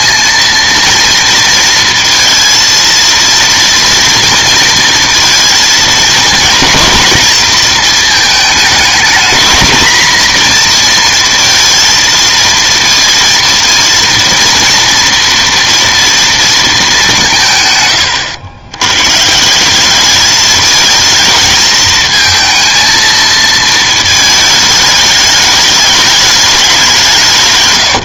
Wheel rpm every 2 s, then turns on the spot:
230, 230, 230, 220, 210, 230, 230, 230, 220, 100, 220, 230, 210, 200.
none